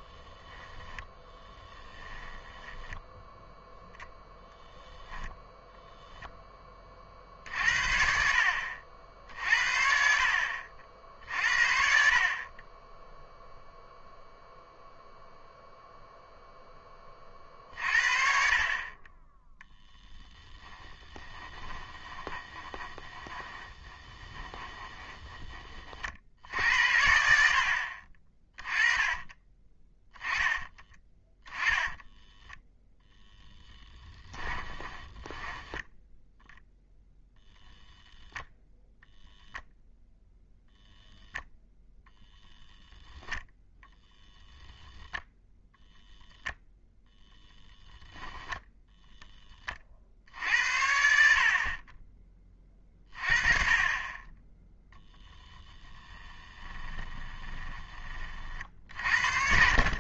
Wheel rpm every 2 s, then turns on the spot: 10, 10, 0, 30, 60, 60, 20, 0, 10, 40, 10, 20, 10, 70, 20, 10, 0, 20, 0, 0, 0, 0, 0, 0, 10, 80, 30, 20, 20, 40.
0-4 20-26 28-32 34-36 54-58